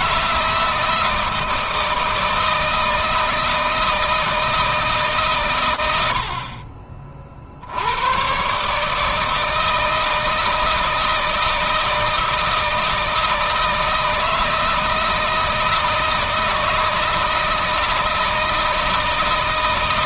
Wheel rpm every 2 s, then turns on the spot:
160, 160, 150, 50, 150, 170, 160, 160, 160, 160.
none